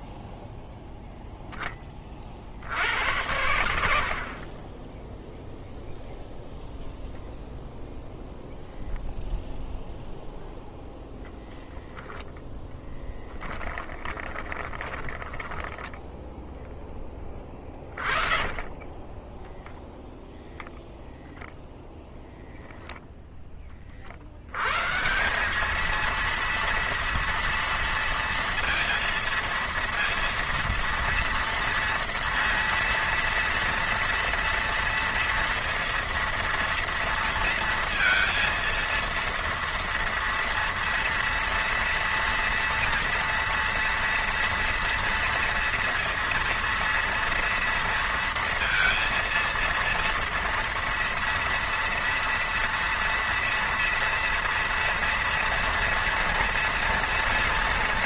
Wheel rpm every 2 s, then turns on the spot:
0, 60, 20, 0, 0, 0, 10, 20, 10, 30, 0, 0, 90, 230, 230, 230, 230, 230, 230, 230, 230, 230, 230, 230, 230, 230, 230, 230, 230.
14-16 18-20